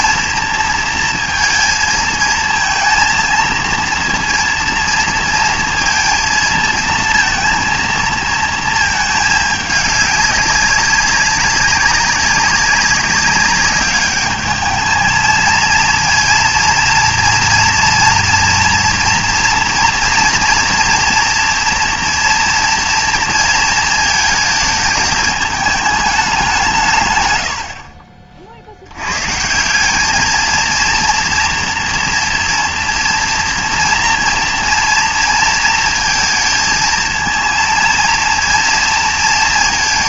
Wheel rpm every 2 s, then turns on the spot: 230, 230, 230, 230, 220, 200, 190, 210, 230, 230, 240, 230, 220, 170, 70, 230, 230, 230, 230, 230.
none